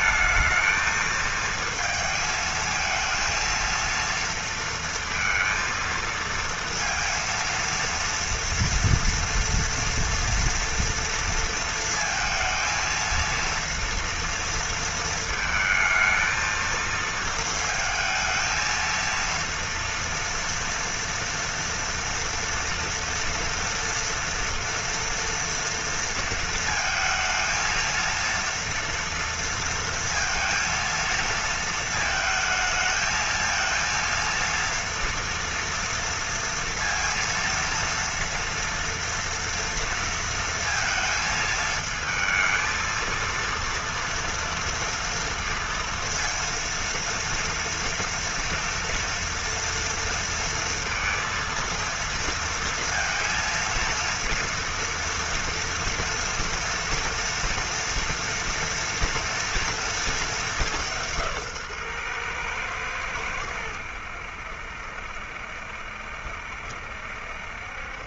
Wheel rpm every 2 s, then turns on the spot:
220, 220, 230, 230, 230, 230, 230, 230, 230, 220, 230, 230, 230, 230, 230, 230, 220, 230, 230, 230, 230, 220, 230, 230, 240, 230, 230, 230, 240, 230, 210, 120, 70, 70.
none